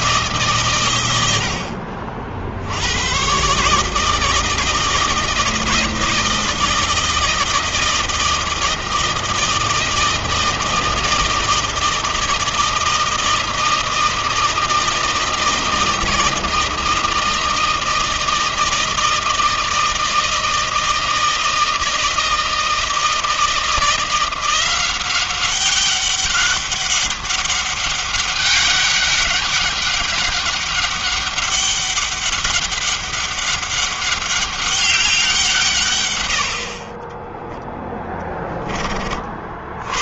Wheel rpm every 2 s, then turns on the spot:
150, 60, 160, 160, 160, 160, 160, 160, 160, 160, 160, 160, 180, 200, 200, 200, 200, 200, 90, 10.
none